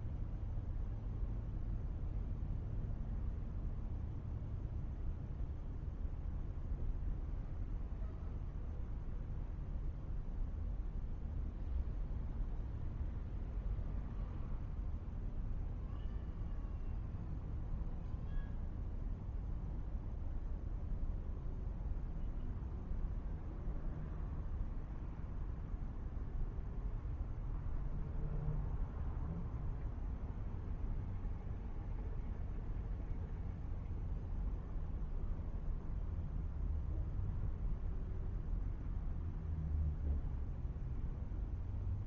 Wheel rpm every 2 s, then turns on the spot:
0, 0, 0, 0, 0, 0, 0, 0, 0, 0, 0, 0, 0, 0, 0, 0, 0, 0, 0, 0, 0.
none